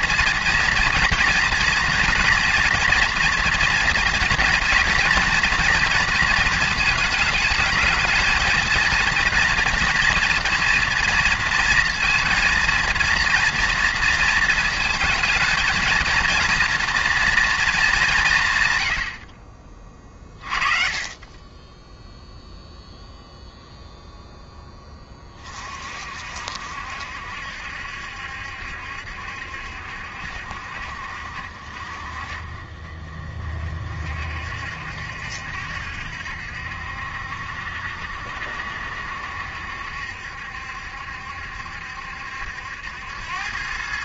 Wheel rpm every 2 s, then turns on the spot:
230, 240, 230, 220, 230, 230, 230, 230, 230, 110, 40, 0, 10, 60, 70, 60, 40, 70, 70, 70, 70, 80.
none